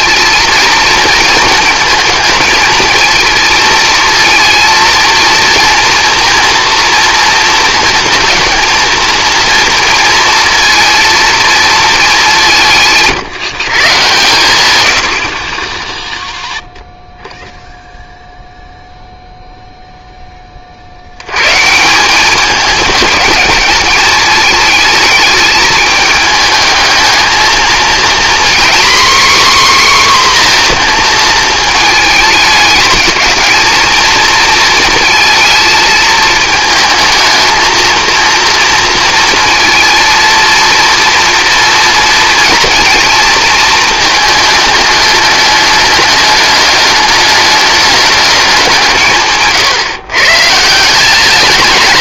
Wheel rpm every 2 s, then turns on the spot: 230, 220, 230, 230, 230, 230, 180, 110, 0, 0, 40, 210, 210, 220, 250, 240, 210, 220, 220, 230, 230, 230, 210, 210, 180, 160.
none